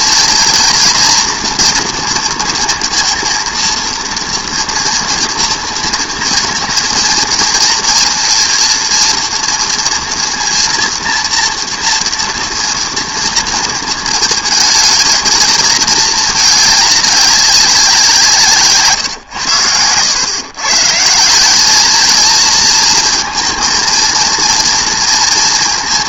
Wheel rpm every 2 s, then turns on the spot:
230, 230, 230, 230, 230, 230, 230, 220, 210, 150, 140, 230, 230.
none